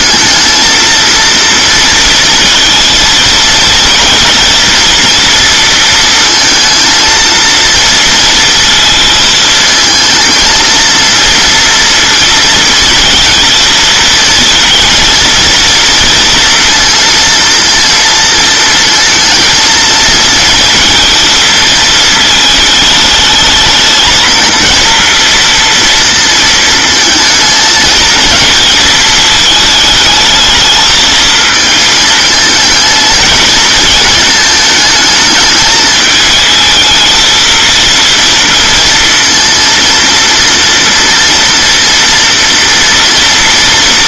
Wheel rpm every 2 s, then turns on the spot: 220, 230, 230, 230, 230, 230, 230, 230, 230, 230, 230, 220, 230, 220, 220, 220, 220, 220, 220, 230, 230, 240.
none